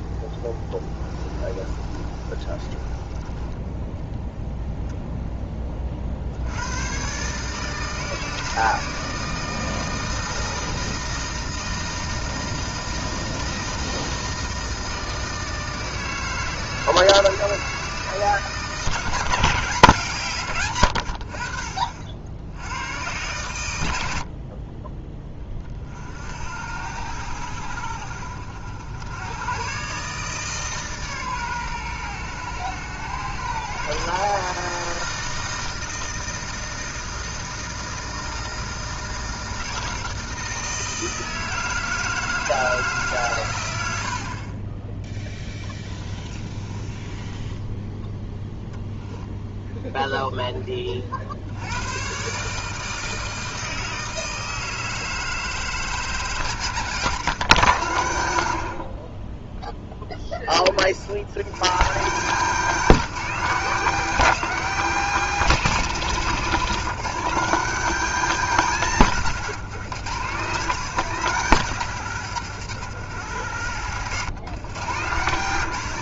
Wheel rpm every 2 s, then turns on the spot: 20, 30, 0, 110, 160, 160, 160, 160, 160, 160, 100, 100, 30, 80, 80, 150, 110, 160, 160, 160, 160, 150, 10, 20, 0, 20, 160, 160, 160, 70, 40, 210, 220, 190, 200, 190, 130, 140.
0-4 46-48 74-76